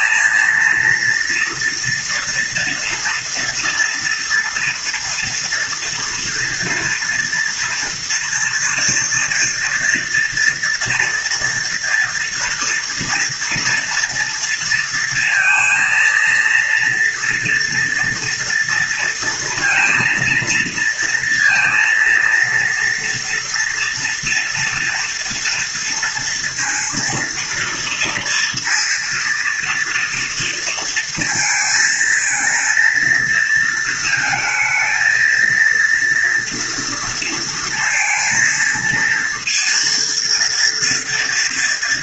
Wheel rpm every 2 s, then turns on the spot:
230, 230, 230, 230, 230, 240, 230, 230, 230, 230, 230, 230, 230, 230, 230, 230, 230, 220, 230, 230, 230.
none